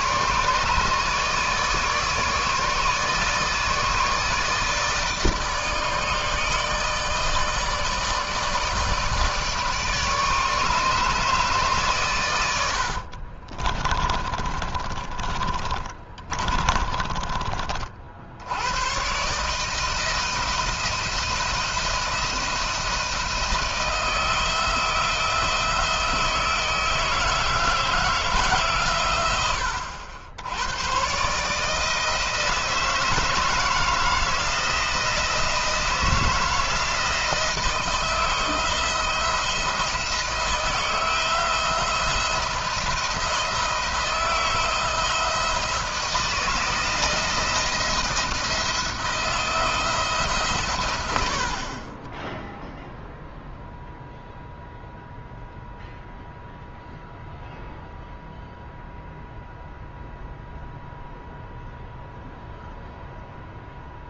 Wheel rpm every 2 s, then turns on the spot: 150, 150, 160, 150, 160, 150, 80, 30, 30, 110, 170, 170, 170, 160, 140, 100, 160, 170, 160, 160, 160, 170, 160, 170, 170, 120, 0, 0, 0, 0, 0, 0.
12-18